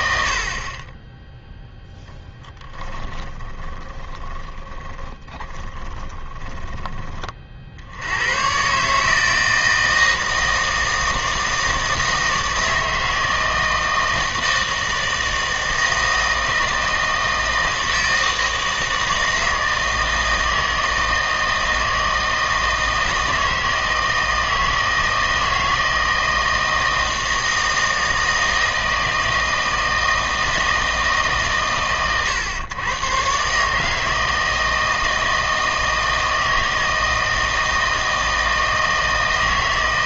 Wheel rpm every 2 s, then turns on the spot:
40, 20, 20, 20, 130, 160, 160, 160, 160, 160, 160, 160, 160, 160, 160, 160, 110, 160, 160, 160.
2-8